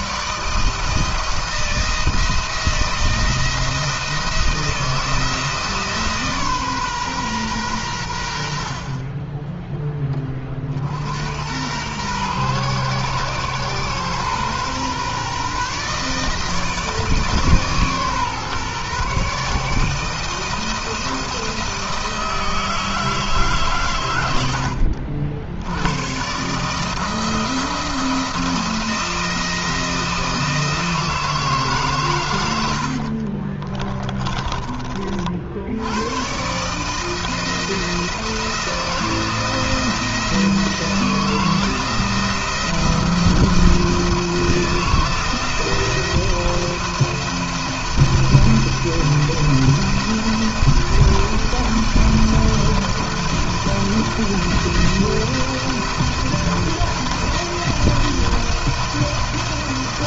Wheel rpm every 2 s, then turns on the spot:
150, 170, 170, 140, 50, 50, 120, 130, 160, 140, 160, 160, 90, 140, 170, 160, 80, 40, 130, 170, 160, 170, 170, 170, 170, 170, 170, 170, 170, 170.
32-34